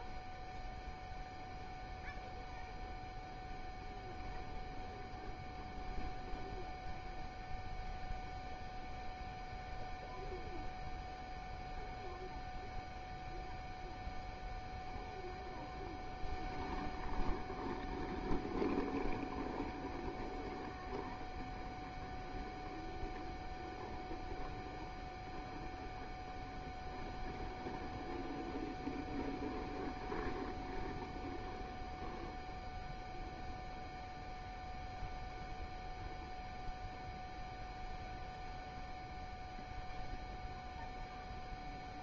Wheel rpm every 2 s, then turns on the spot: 0, 0, 0, 0, 0, 0, 0, 0, 0, 0, 0, 0, 0, 0, 0, 0, 0, 0, 0, 0, 0.
none